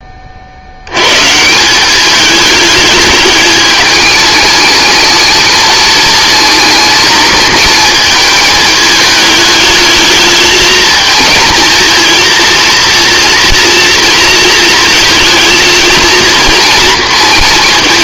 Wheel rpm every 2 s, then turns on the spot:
110, 210, 220, 220, 210, 220, 230, 220, 230.
none